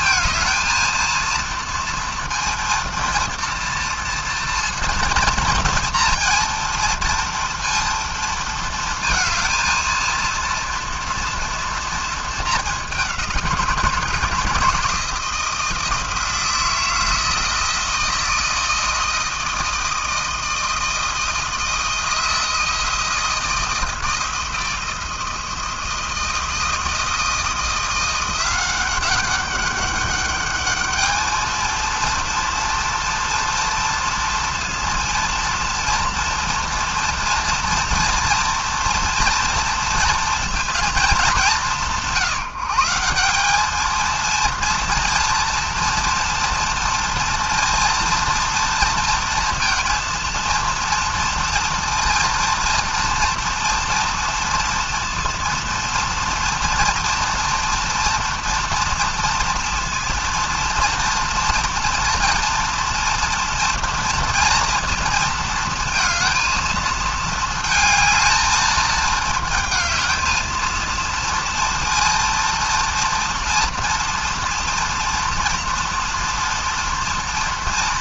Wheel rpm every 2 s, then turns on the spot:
220, 230, 240, 230, 230, 230, 200, 160, 160, 160, 160, 160, 160, 170, 190, 210, 230, 230, 230, 230, 230, 160, 240, 230, 230, 230, 230, 230, 230, 230, 230, 230, 230, 230, 220, 230, 230, 240, 230.
none